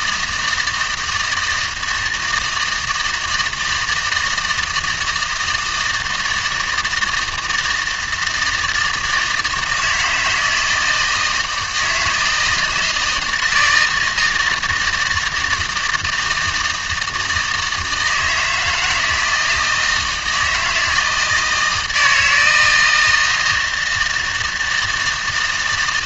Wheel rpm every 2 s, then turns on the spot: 160, 160, 160, 160, 160, 160, 160, 160, 160, 160, 160, 160, 160.
none